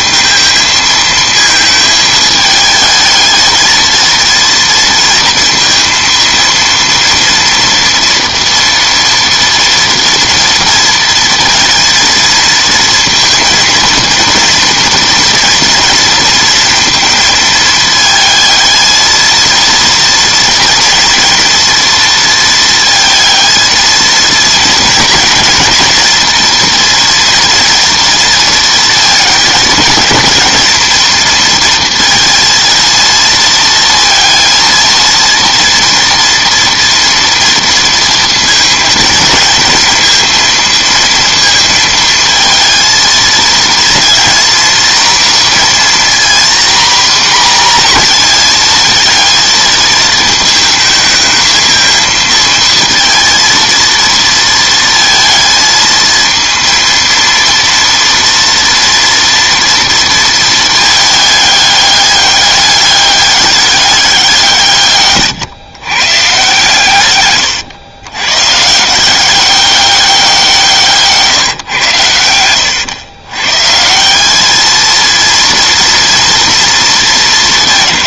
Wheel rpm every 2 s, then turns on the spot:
220, 220, 230, 230, 230, 230, 230, 230, 230, 220, 230, 230, 230, 230, 230, 220, 230, 230, 240, 230, 230, 230, 230, 240, 230, 220, 220, 230, 230, 230, 220, 200, 160, 140, 140, 180, 100, 210, 230.
72-74